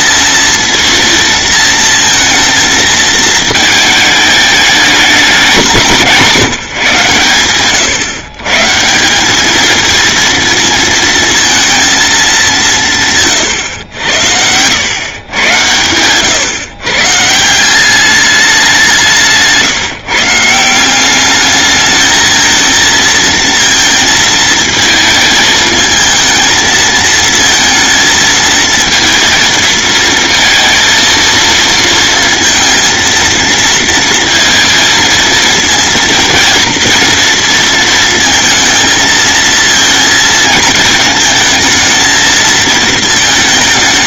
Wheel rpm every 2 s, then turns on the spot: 230, 230, 210, 170, 140, 230, 190, 100, 130, 190, 170, 230, 230, 220, 230, 230, 230, 230, 230, 230, 220, 220.
none